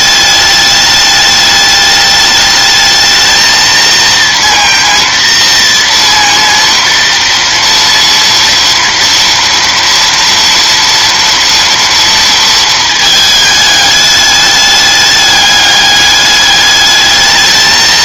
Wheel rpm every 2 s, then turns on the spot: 210, 210, 230, 230, 230, 230, 230, 210, 210.
none